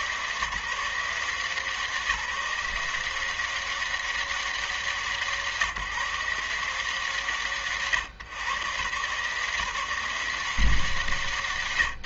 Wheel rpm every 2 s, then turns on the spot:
140, 170, 200, 160, 130, 170.
none